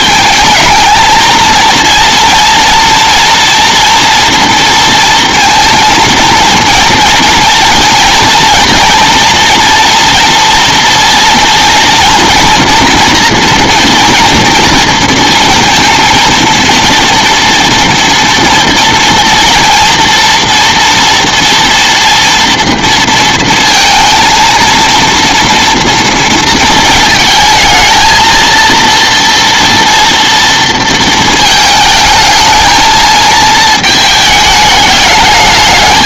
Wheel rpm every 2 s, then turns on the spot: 220, 230, 230, 230, 230, 230, 230, 230, 230, 230, 230, 230, 230, 220, 230, 230, 220, 210.
none